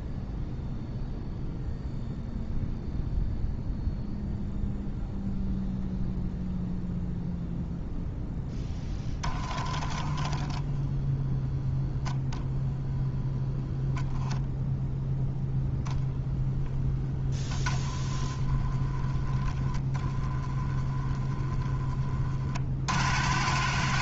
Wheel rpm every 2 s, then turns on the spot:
0, 0, 0, 0, 10, 10, 0, 0, 0, 10, 10, 50.
8-10